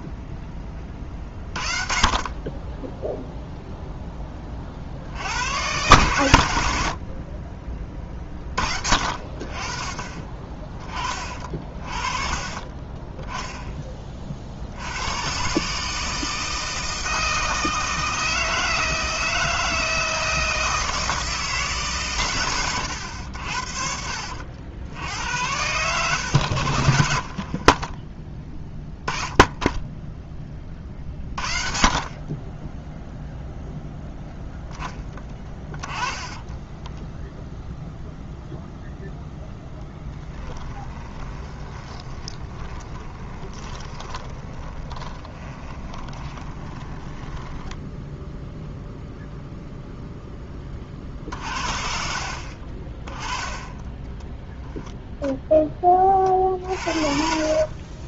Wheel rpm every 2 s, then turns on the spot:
10, 10, 30, 90, 40, 30, 30, 60, 160, 160, 160, 110, 60, 80, 20, 30, 20, 10, 10, 0, 20, 20, 20, 20, 0, 20, 40, 10, 50.
36-38 40-48 52-54 56-58